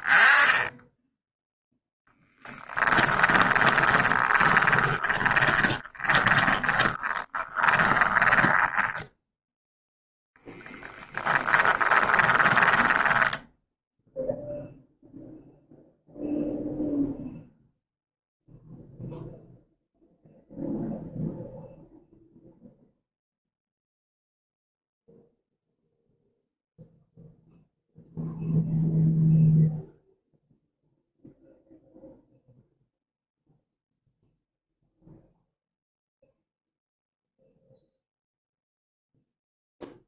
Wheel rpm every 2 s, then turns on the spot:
0, 10, 20, 20, 10, 10, 10, 0, 0, 0, 0, 0, 0, 0, 0, 0, 0, 0, 0, 0.
2-14